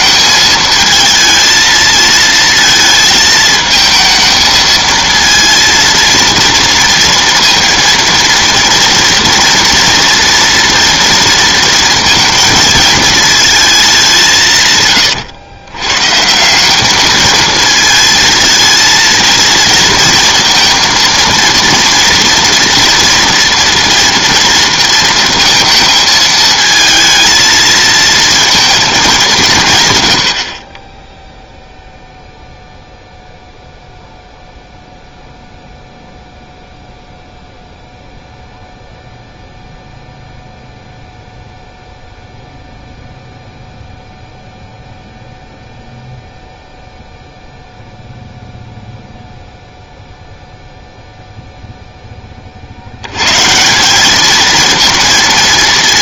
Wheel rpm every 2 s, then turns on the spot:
220, 220, 220, 230, 230, 230, 230, 140, 200, 230, 230, 230, 230, 220, 220, 30, 0, 0, 0, 0, 0, 0, 0, 0, 0, 0, 80, 230.
none